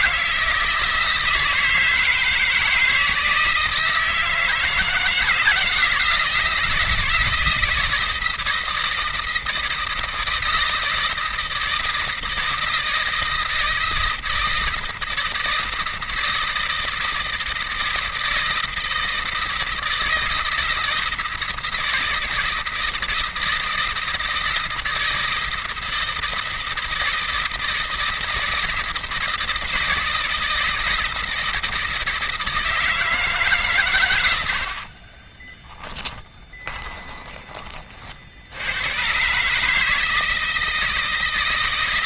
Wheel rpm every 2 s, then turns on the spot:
160, 160, 160, 160, 160, 160, 160, 160, 160, 160, 160, 160, 160, 160, 160, 160, 150, 30, 20, 120, 160.
34-36